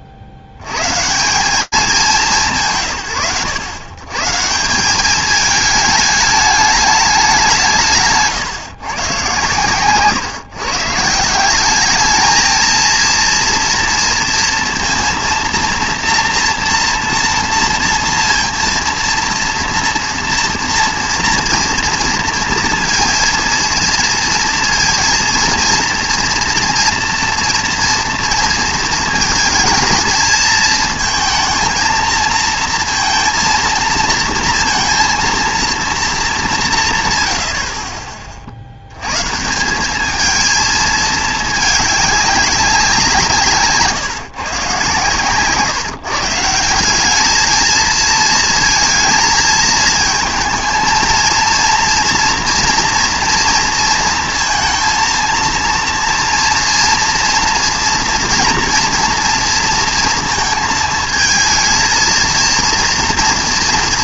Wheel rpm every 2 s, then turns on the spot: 70, 160, 190, 210, 130, 150, 230, 230, 230, 230, 230, 230, 230, 230, 230, 220, 230, 230, 170, 80, 220, 190, 130, 180, 220, 220, 230, 230, 240, 230, 220, 230.
none